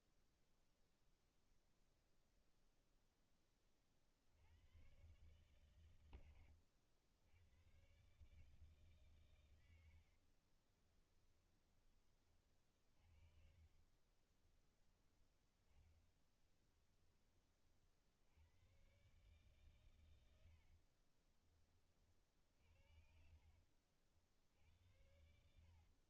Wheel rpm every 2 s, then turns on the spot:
0, 0, 110, 100, 140, 20, 40, 20, 20, 120, 50, 60, 80.
10-16 20-26